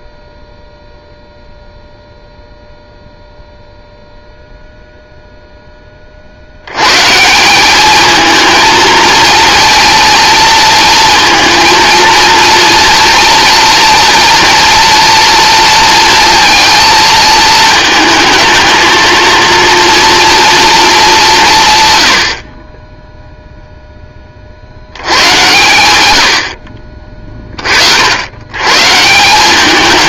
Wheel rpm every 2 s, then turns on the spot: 0, 0, 0, 100, 230, 230, 230, 230, 230, 220, 230, 30, 70, 50, 140.
none